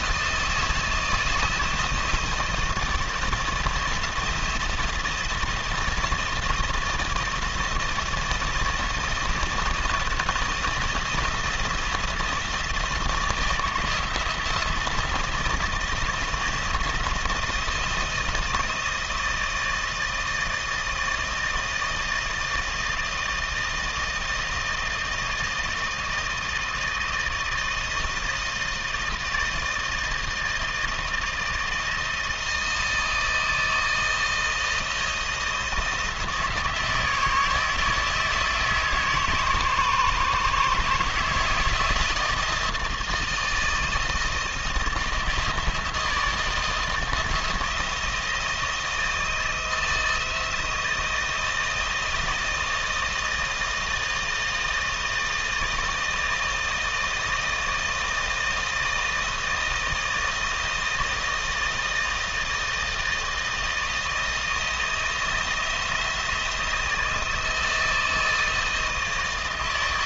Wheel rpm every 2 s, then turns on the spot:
160, 160, 170, 160, 170, 170, 160, 160, 170, 160, 160, 160, 160, 160, 160, 160, 160, 160, 160, 160, 150, 160, 170, 160, 160, 160, 160, 160, 160, 160, 160, 160, 170, 160, 160.
none